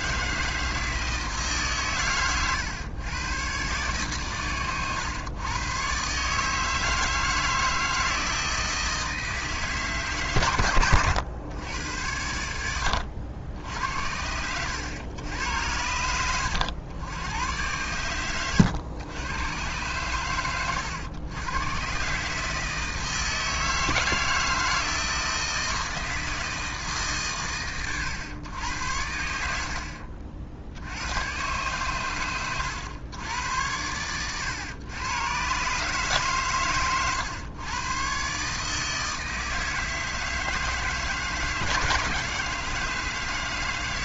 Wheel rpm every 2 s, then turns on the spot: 160, 120, 120, 150, 160, 120, 80, 90, 90, 100, 100, 150, 160, 160, 100, 60, 110, 110, 130, 140, 160, 160.
none